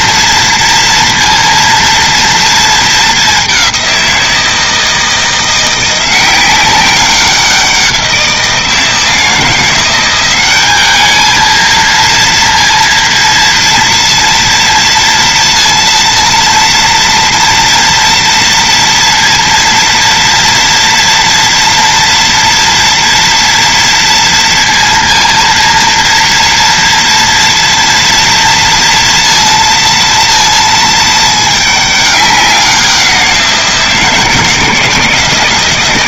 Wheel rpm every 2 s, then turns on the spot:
230, 220, 170, 190, 170, 200, 230, 230, 230, 230, 230, 230, 230, 230, 230, 230, 190, 170.
none